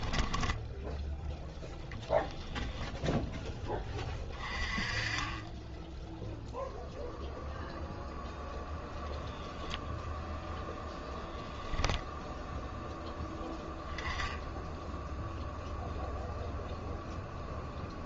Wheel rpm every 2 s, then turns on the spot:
0, 10, 20, 0, 0, 0, 0, 0, 0.
none